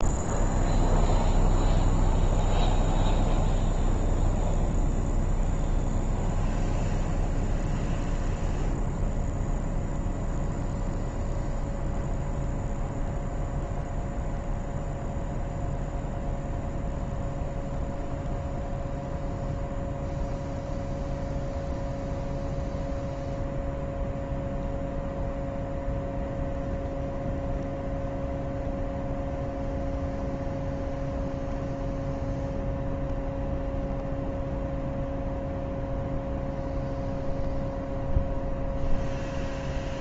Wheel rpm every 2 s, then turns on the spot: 0, 0, 0, 0, 0, 0, 0, 0, 0, 0, 0, 0, 0, 0, 0, 0, 0, 0, 0, 0.
none